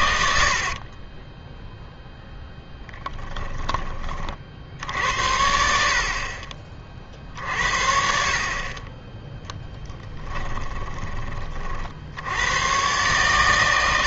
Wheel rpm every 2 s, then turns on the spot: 60, 10, 60, 40, 30, 20, 110.
0-4 10-12